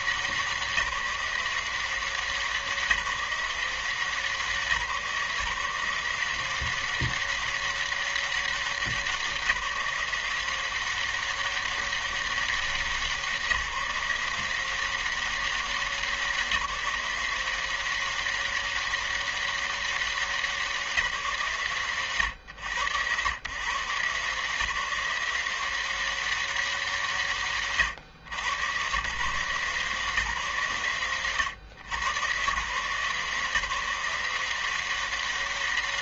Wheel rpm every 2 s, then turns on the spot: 190, 180, 170, 170, 200, 180, 190, 160, 180, 190, 190, 100, 140, 190, 110, 160, 120, 180.
none